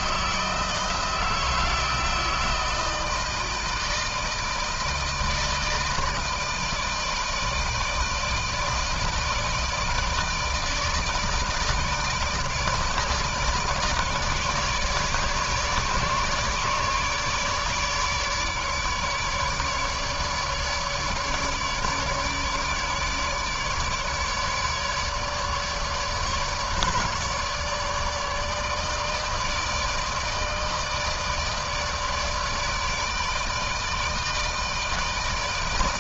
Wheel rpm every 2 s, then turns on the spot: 160, 160, 160, 160, 160, 150, 150, 150, 150, 150, 150, 150, 150, 150, 150, 160, 150, 160.
none